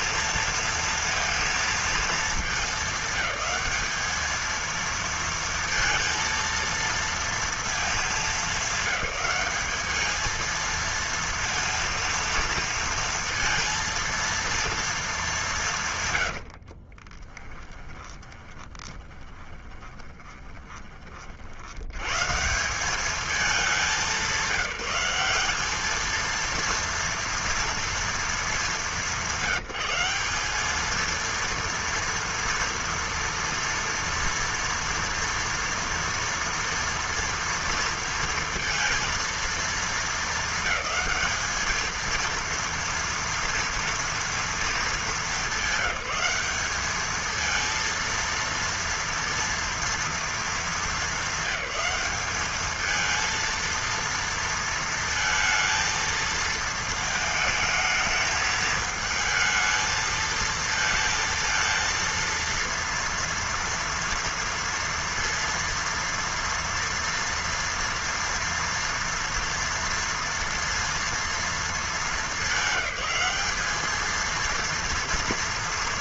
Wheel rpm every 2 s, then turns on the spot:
230, 210, 220, 230, 200, 220, 230, 230, 90, 30, 20, 140, 190, 230, 220, 200, 230, 230, 230, 230, 220, 230, 230, 200, 230, 220, 210, 230, 220, 220, 220, 230, 230, 230, 230, 230, 210, 230.
16-22